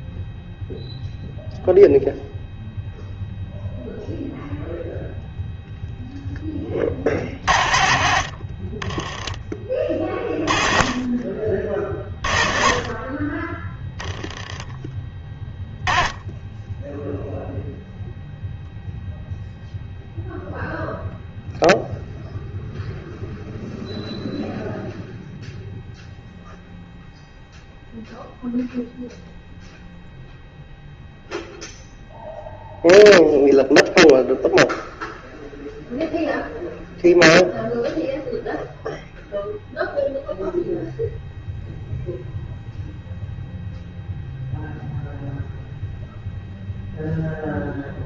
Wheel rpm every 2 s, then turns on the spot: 0, 0, 0, 30, 30, 30, 40, 10, 10, 0, 0, 0, 0, 0, 0, 0, 0, 0, 0, 0, 0, 0, 0, 0.
none